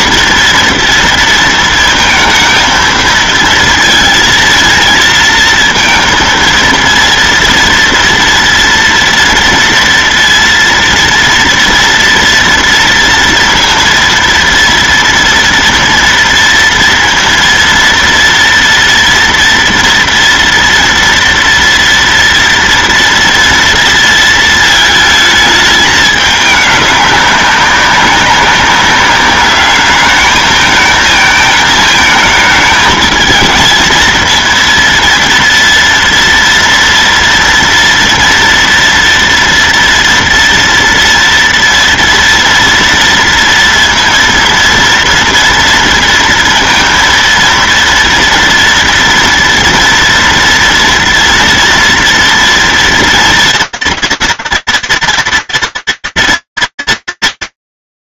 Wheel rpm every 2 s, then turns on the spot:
230, 230, 230, 230, 230, 230, 230, 230, 230, 230, 230, 230, 220, 200, 200, 220, 220, 230, 230, 230, 230, 230, 230, 230, 230, 240, 230, 230, 230.
none